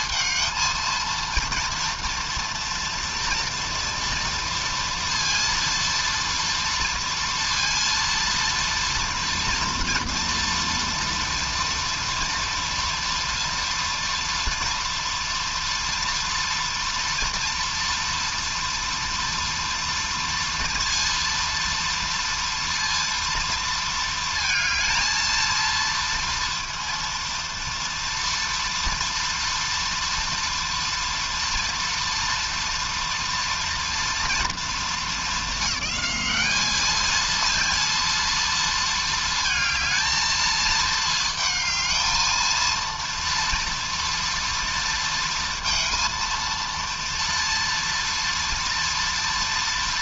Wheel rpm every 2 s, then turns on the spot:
230, 230, 230, 230, 230, 230, 230, 230, 230, 230, 230, 230, 230, 230, 230, 240, 230, 230, 210, 230, 220, 230, 230, 230, 230.
none